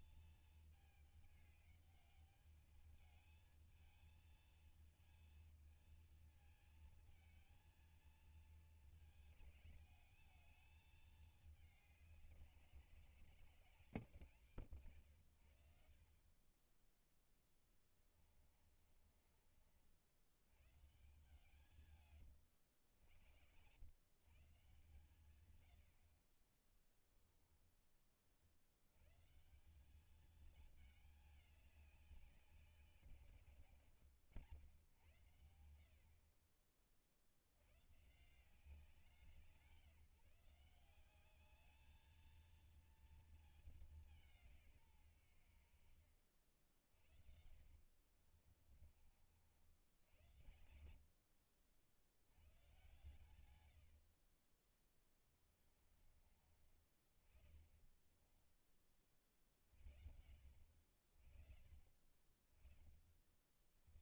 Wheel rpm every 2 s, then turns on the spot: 220, 210, 230, 220, 220, 210, 190, 140, 30, 30, 100, 120, 150, 30, 50, 210, 190, 110, 50, 160, 170, 220, 180, 50, 60, 80, 90, 30, 30, 20, 70, 40.
16-20 22-24 48-52 54-56